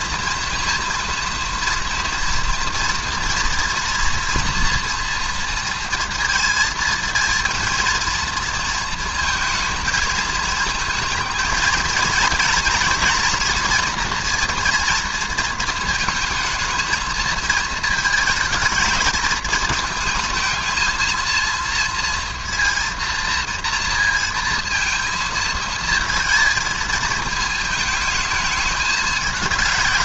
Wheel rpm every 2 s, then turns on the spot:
230, 230, 230, 230, 230, 220, 230, 230, 230, 220, 220, 230, 230, 220, 220.
none